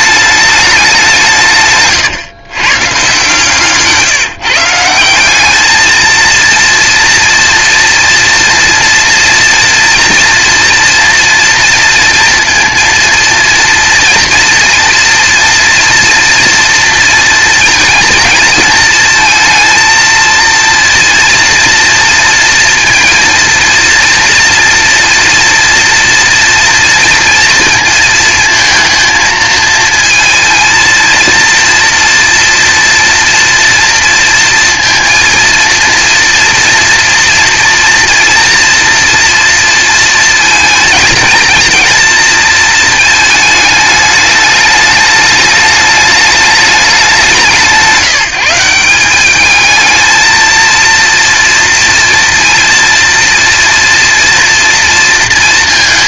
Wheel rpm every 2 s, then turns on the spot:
210, 120, 170, 230, 230, 230, 230, 230, 240, 230, 230, 230, 230, 230, 220, 230, 230, 230, 230, 230, 220, 220, 210, 210, 170, 230, 230, 230.
none